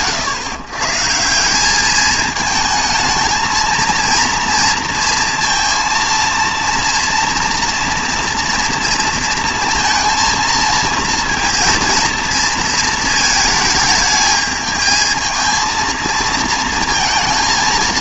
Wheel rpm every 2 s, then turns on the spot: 140, 220, 230, 230, 230, 230, 220, 220, 220.
none